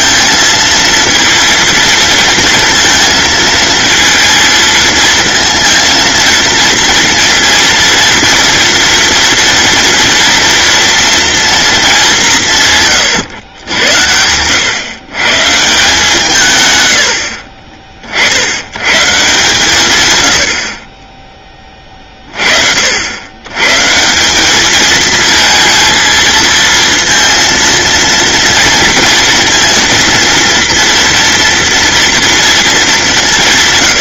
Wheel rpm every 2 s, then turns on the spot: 230, 230, 230, 230, 230, 230, 130, 120, 110, 130, 30, 60, 220, 230, 230, 230, 210.
none